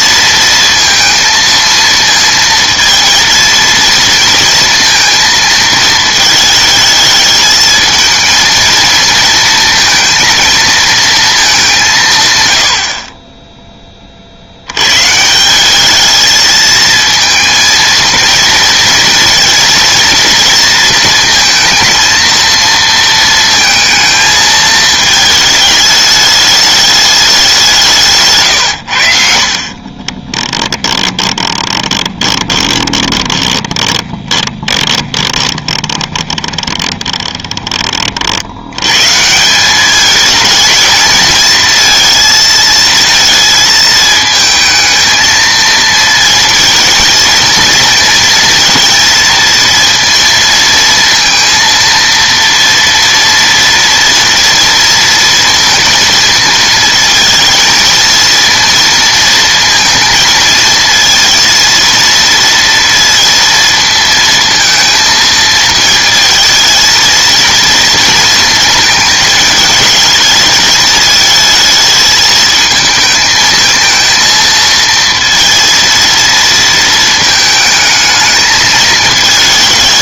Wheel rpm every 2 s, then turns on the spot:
230, 230, 230, 220, 230, 220, 60, 110, 220, 230, 230, 220, 220, 210, 90, 10, 20, 20, 20, 100, 220, 230, 220, 220, 230, 230, 230, 230, 220, 230, 230, 230, 230, 230, 220, 220, 220, 230, 230, 220.
30-38